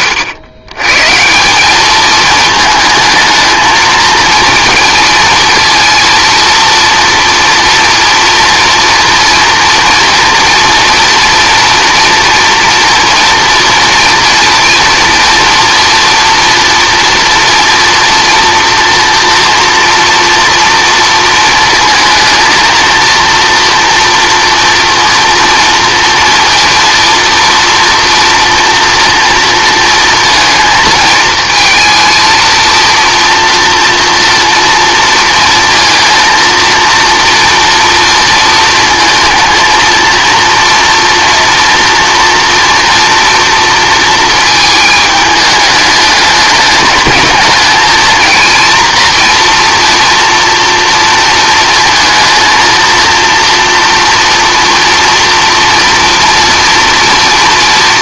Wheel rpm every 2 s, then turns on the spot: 110, 220, 230, 230, 230, 230, 230, 240, 230, 230, 230, 220, 230, 230, 230, 220, 230, 230, 230, 230, 230, 230, 220, 210, 230, 230, 230, 230, 230.
none